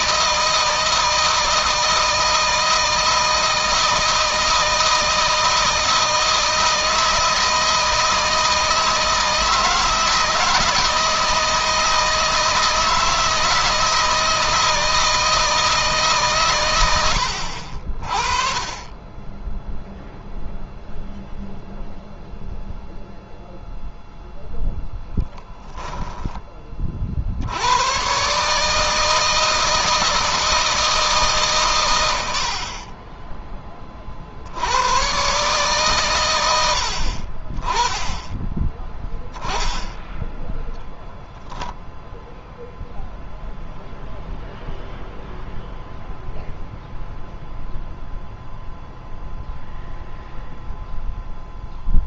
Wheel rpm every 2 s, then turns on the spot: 160, 160, 160, 160, 160, 160, 160, 160, 100, 20, 0, 0, 10, 30, 150, 160, 40, 100, 80, 10, 0, 0, 0, 0, 0, 0.
none